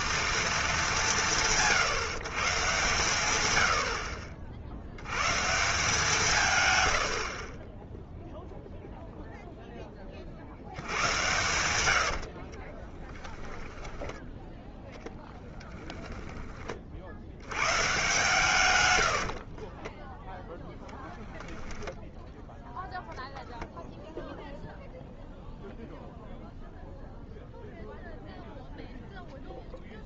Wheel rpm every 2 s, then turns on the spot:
210, 150, 70, 110, 0, 80, 20, 10, 30, 120, 0, 0, 0, 0, 0.
12-14